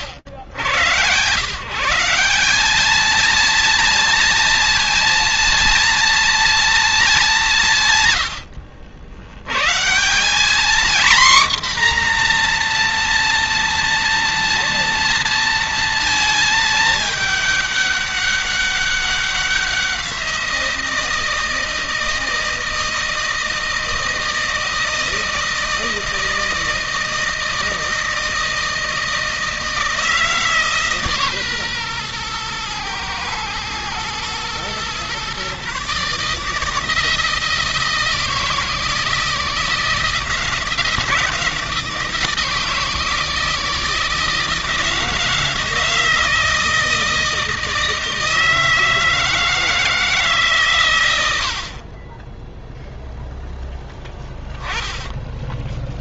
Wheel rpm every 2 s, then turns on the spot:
120, 180, 230, 230, 90, 190, 250, 230, 220, 200, 180, 160, 160, 160, 160, 150, 120, 120, 150, 160, 160, 160, 160, 160, 160, 150, 10, 10.
none